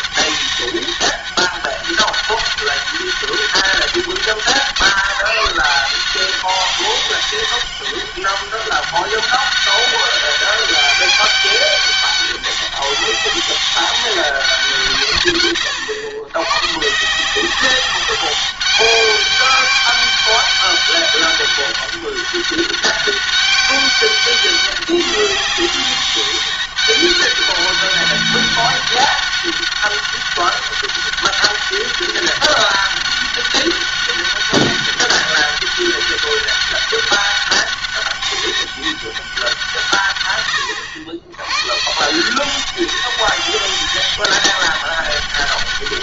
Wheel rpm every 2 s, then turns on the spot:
200, 200, 190, 190, 200, 200, 200, 170, 130, 190, 200, 200, 200, 200, 200, 200, 200, 200, 200, 200, 110, 180, 200.
none